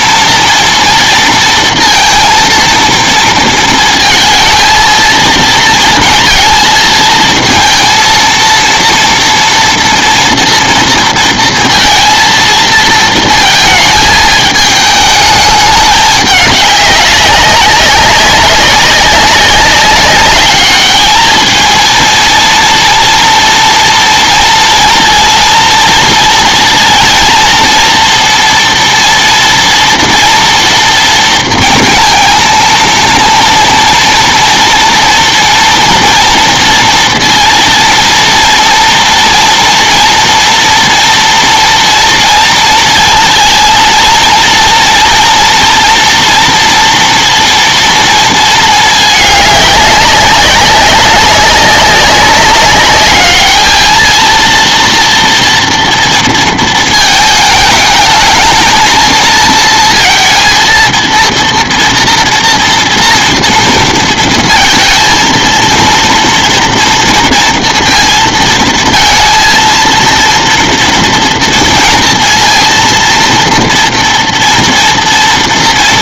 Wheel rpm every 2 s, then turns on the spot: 230, 230, 230, 230, 230, 230, 230, 220, 200, 190, 210, 230, 230, 230, 230, 230, 230, 230, 230, 230, 240, 230, 230, 230, 220, 200, 200, 230, 230, 220, 230, 240, 230, 230, 230, 230, 230, 230.
none